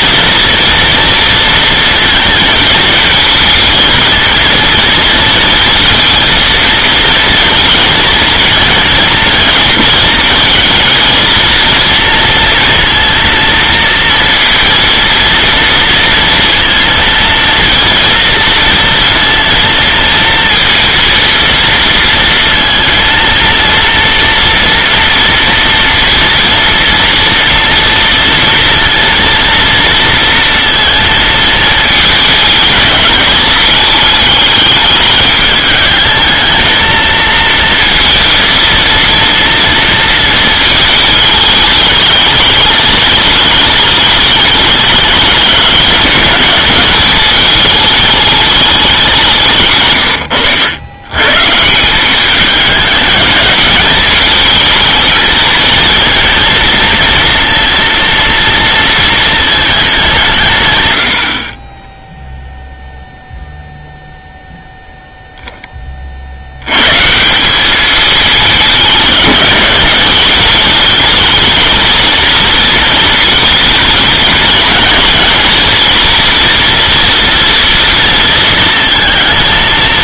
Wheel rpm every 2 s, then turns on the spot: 230, 220, 230, 230, 230, 230, 230, 230, 230, 230, 230, 230, 230, 230, 230, 230, 220, 210, 220, 230, 220, 210, 210, 210, 200, 100, 200, 220, 230, 230, 120, 0, 0, 100, 220, 210, 230, 230, 230, 230.
none